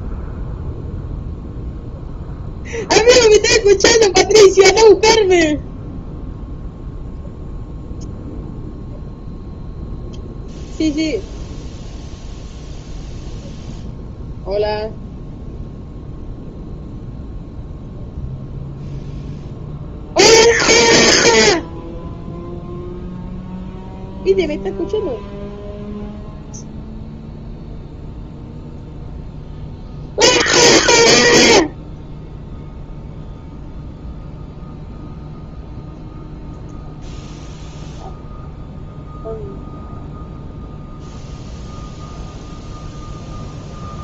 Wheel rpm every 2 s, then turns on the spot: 0, 0, 0, 0, 0, 0, 0, 0, 0, 0, 0, 0, 0, 0, 0, 0, 0, 0, 0, 0, 0, 0.
none